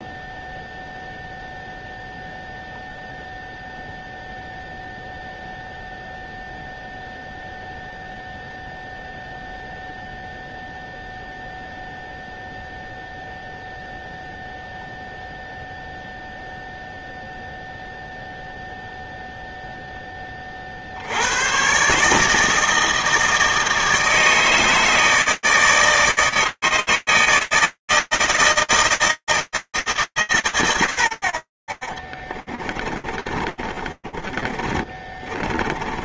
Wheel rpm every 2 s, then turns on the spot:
0, 0, 0, 0, 0, 0, 0, 0, 0, 0, 0, 110, 160, 160, 130, 30, 30, 20.
30-36